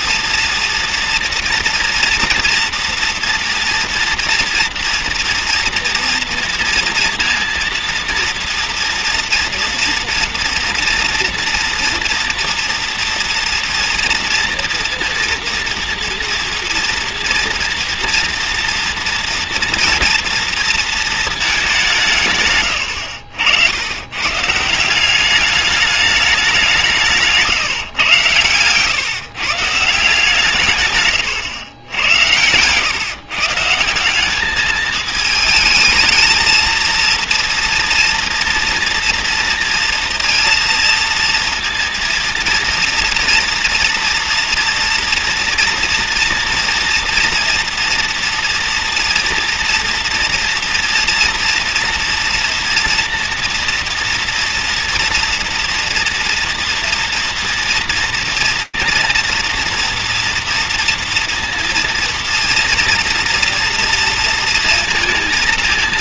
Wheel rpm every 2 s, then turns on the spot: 230, 230, 230, 230, 230, 230, 230, 230, 230, 230, 230, 110, 160, 190, 110, 150, 100, 210, 230, 230, 230, 230, 230, 230, 240, 230, 230, 240, 230, 230, 230, 230, 230.
22-24